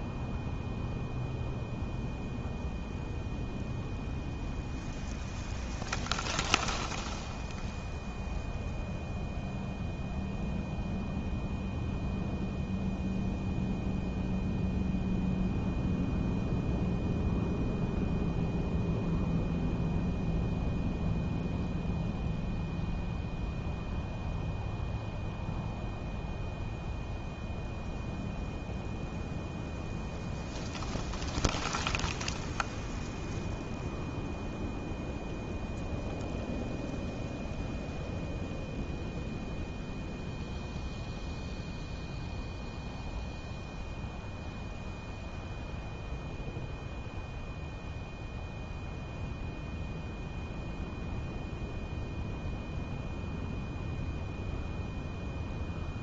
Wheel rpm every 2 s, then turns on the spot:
0, 0, 0, 0, 0, 0, 0, 0, 0, 0, 0, 0, 0, 0, 0, 0, 0, 0, 0, 0, 0, 0, 0, 0, 0, 0, 0, 0.
none